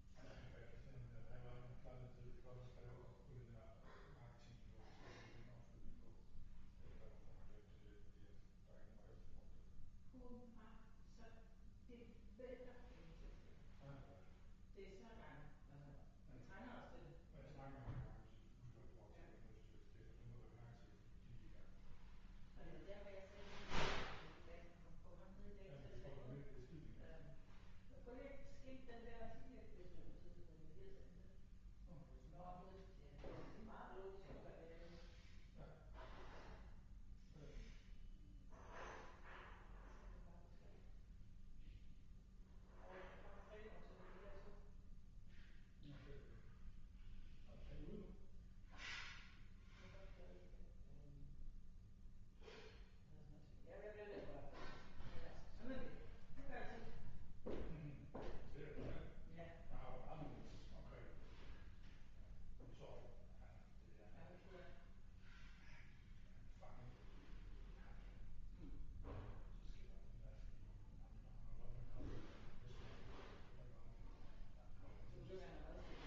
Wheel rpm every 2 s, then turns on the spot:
0, 0, 0, 0, 0, 0, 0, 0, 0, 0, 0, 0, 0, 0, 0, 0, 0, 0, 0, 0, 0, 0, 0, 0, 0, 0, 0, 0, 0, 0, 0, 0, 0, 0, 0, 0, 0, 0.
none